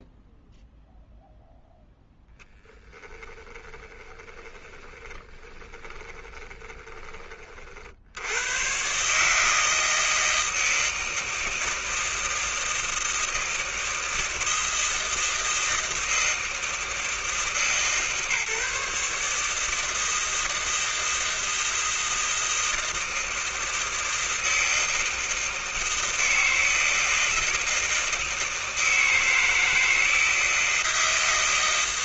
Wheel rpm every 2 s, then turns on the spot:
0, 10, 20, 20, 70, 160, 160, 160, 160, 140, 160, 160, 160, 160, 160, 160.
4-8